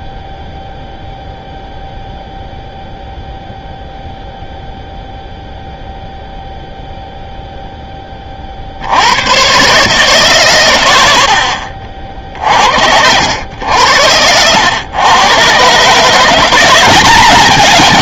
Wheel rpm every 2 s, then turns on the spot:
0, 0, 0, 0, 60, 110, 60, 100, 190.
none